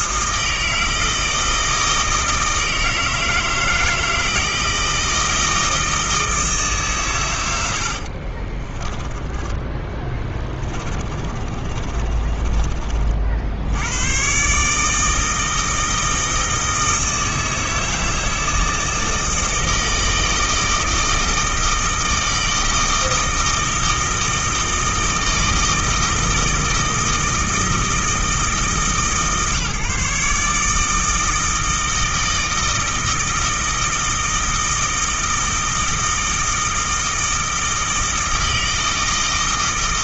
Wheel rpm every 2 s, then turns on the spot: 160, 160, 160, 150, 30, 20, 30, 140, 160, 160, 160, 160, 160, 160, 150, 150, 160, 160, 160, 160.
8-14